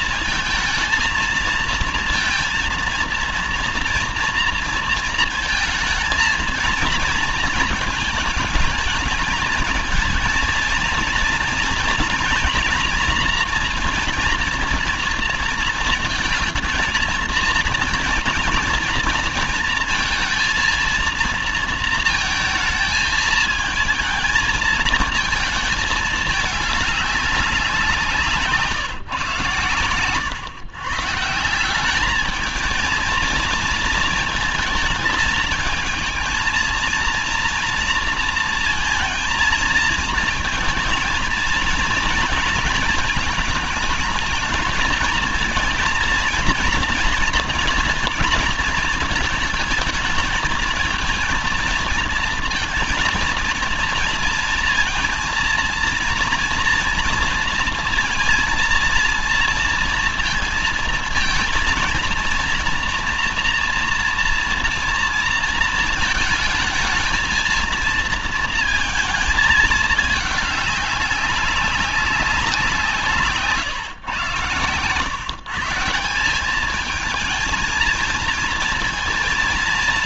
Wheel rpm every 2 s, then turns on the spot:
230, 230, 230, 230, 220, 230, 230, 230, 220, 230, 230, 220, 220, 210, 150, 130, 220, 220, 230, 230, 220, 220, 220, 230, 220, 220, 230, 230, 230, 230, 230, 230, 230, 220, 230, 200, 180, 130, 200, 230.
none